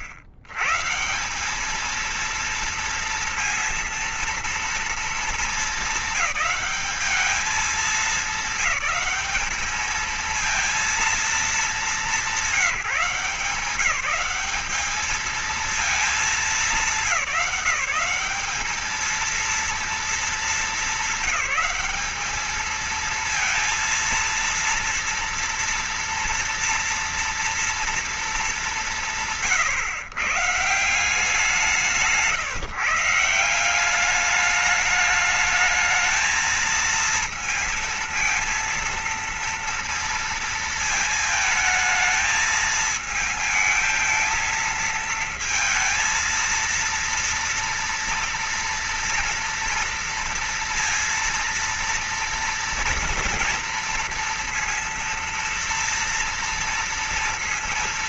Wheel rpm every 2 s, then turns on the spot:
130, 230, 230, 210, 200, 220, 190, 200, 220, 210, 220, 220, 230, 230, 210, 150, 160, 210, 220, 230, 230, 220, 220, 230, 230, 230, 230, 230, 230.
none